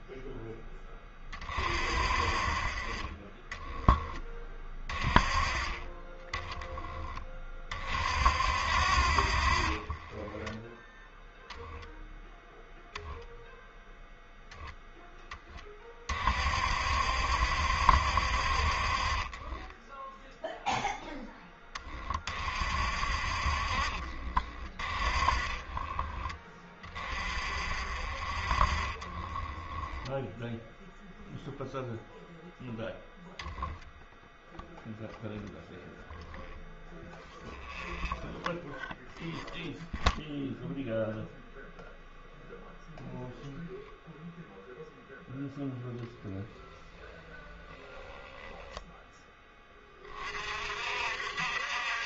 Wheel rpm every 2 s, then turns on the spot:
10, 30, 30, 20, 60, 10, 0, 10, 70, 60, 0, 50, 30, 30, 30, 0, 0, 0, 0, 0, 0, 0, 0, 20, 10, 50.
28-30